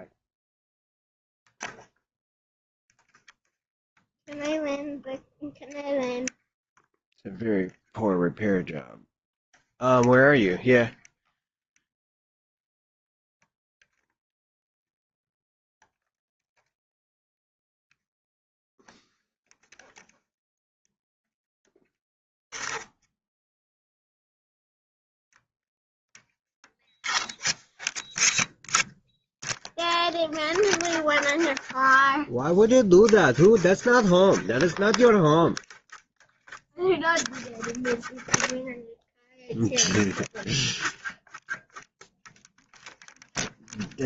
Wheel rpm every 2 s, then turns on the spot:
0, 0, 0, 0, 0, 0, 0, 0, 0, 0, 0, 0, 0, 0, 0, 0, 0, 0, 0, 0, 0, 0.
none